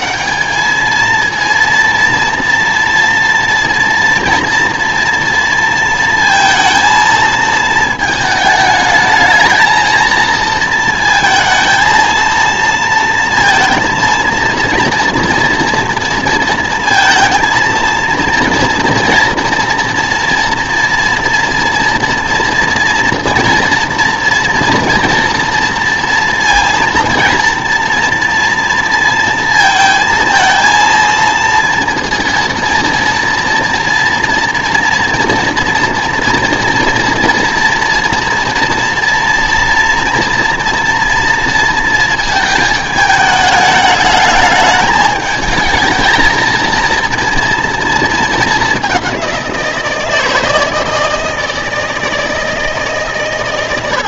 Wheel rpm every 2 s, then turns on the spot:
210, 240, 230, 230, 210, 230, 230, 230, 230, 230, 230, 230, 230, 230, 230, 230, 230, 240, 240, 230, 230, 220, 210, 230, 200, 160, 150.
none